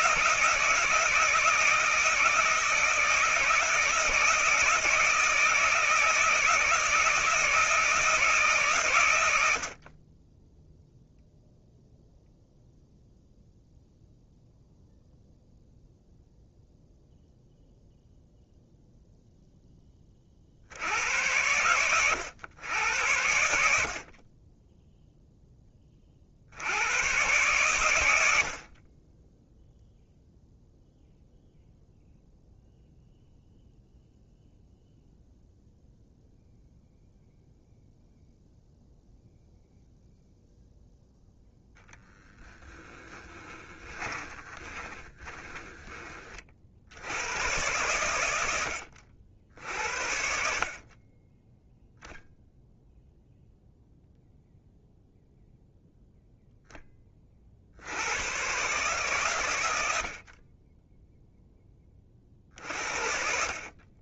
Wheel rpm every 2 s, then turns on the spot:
160, 160, 160, 160, 140, 10, 0, 0, 0, 0, 70, 100, 10, 90, 40, 0, 0, 0, 0, 0, 0, 10, 20, 70, 80, 50, 0, 0, 10, 130, 20, 50.
42-46